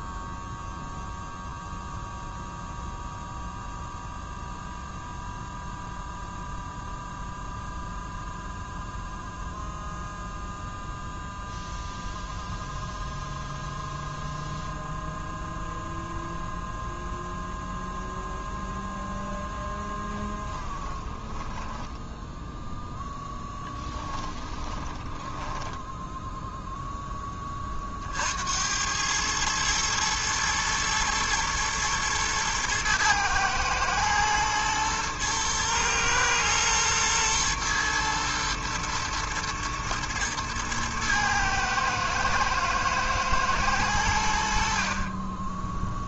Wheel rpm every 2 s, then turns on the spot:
0, 0, 0, 0, 0, 0, 0, 0, 0, 0, 10, 0, 10, 10, 100, 110, 110, 110, 120, 120, 110, 110, 40.
20-22 24-26